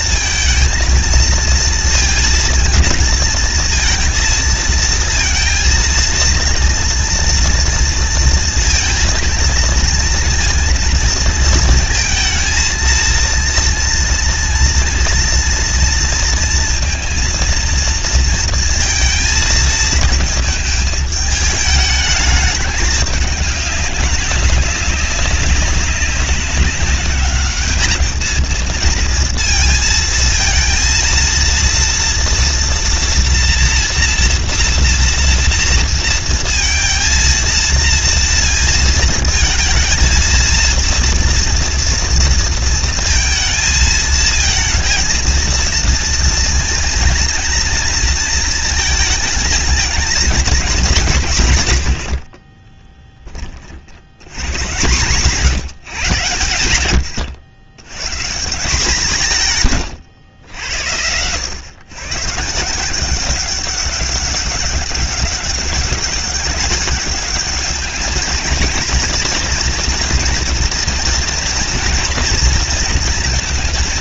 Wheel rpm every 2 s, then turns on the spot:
220, 230, 230, 230, 230, 230, 230, 240, 230, 230, 220, 210, 210, 200, 220, 230, 240, 240, 230, 230, 230, 230, 230, 230, 220, 230, 40, 100, 120, 150, 100, 150, 200, 200, 220, 230, 230.
52-54